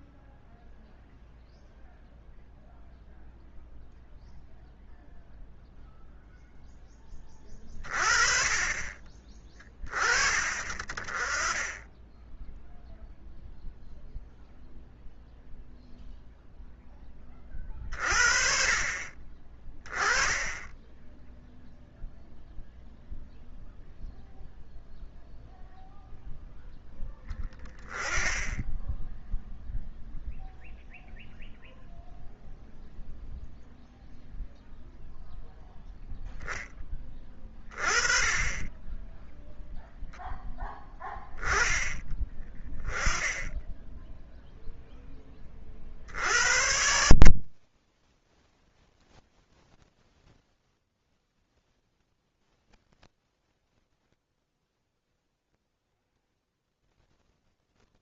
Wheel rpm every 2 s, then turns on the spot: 0, 0, 0, 10, 40, 40, 0, 0, 0, 40, 10, 0, 0, 0, 10, 0, 0, 0, 10, 20, 10, 20, 0, 70, 30, 0, 10, 20, 10.
none